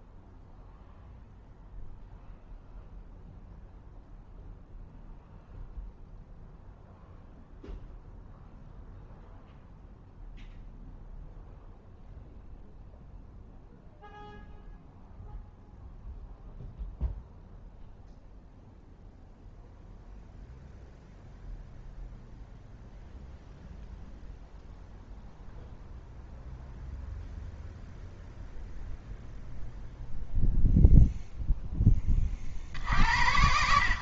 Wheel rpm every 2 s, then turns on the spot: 0, 0, 0, 0, 0, 0, 0, 0, 0, 0, 0, 0, 0, 0, 0, 0, 50.
none